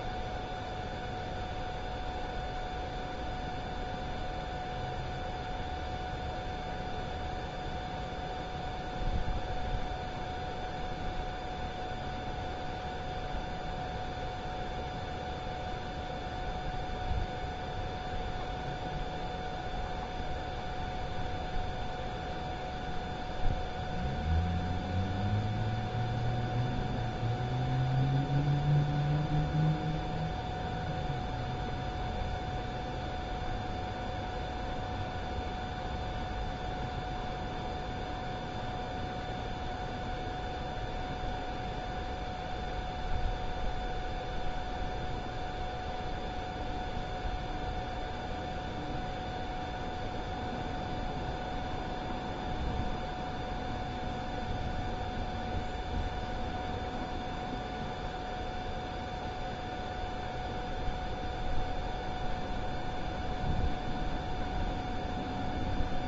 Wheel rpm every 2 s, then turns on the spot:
0, 0, 0, 0, 0, 0, 0, 0, 0, 0, 0, 0, 0, 0, 0, 0, 0, 0, 0, 0, 0, 0, 0, 0, 0, 0, 0, 0, 0, 0, 0, 0, 0.
none